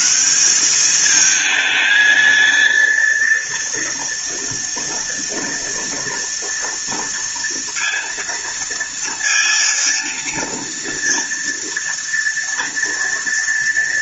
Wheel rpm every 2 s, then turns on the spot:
210, 230, 230, 230, 230, 230, 230.
none